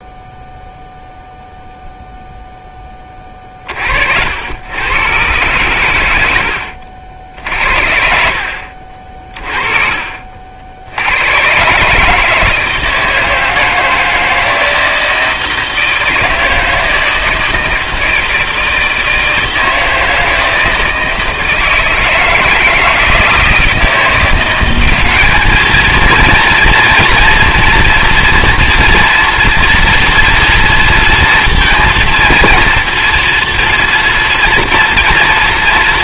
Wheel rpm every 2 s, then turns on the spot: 0, 10, 110, 60, 40, 70, 160, 160, 160, 160, 160, 160, 190, 230, 230, 240, 230, 230.
none